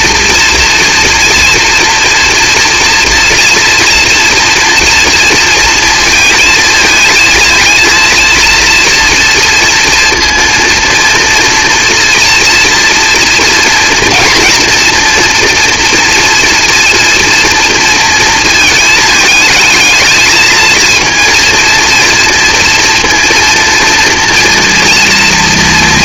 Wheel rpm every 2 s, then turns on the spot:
230, 230, 240, 230, 230, 230, 230, 230, 230, 220, 230, 240, 230.
none